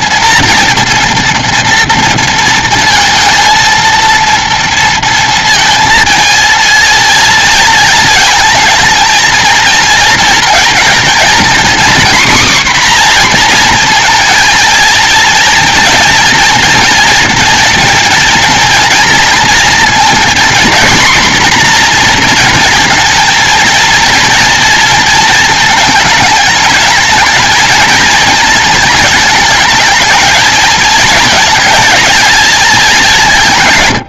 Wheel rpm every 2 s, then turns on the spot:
230, 230, 230, 230, 220, 230, 260, 230, 230, 230, 240, 240, 230, 220, 230, 220, 220.
none